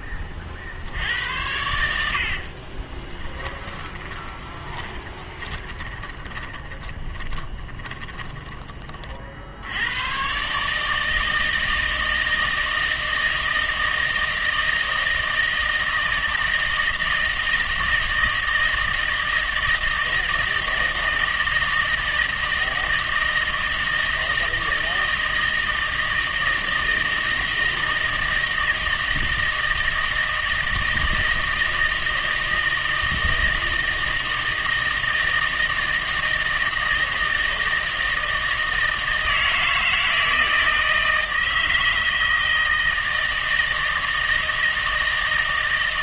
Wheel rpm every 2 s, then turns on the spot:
60, 30, 20, 20, 30, 150, 160, 160, 160, 160, 160, 160, 160, 160, 160, 160, 160, 160, 160, 160, 160, 160, 160.
2-8